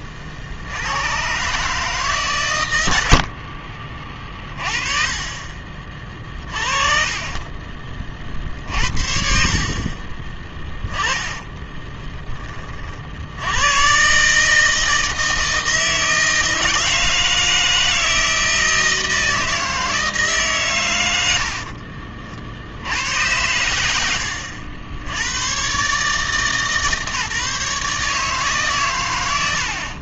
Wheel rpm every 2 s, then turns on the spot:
70, 100, 30, 30, 50, 10, 30, 160, 160, 160, 130, 70, 90, 150, 140.
10-12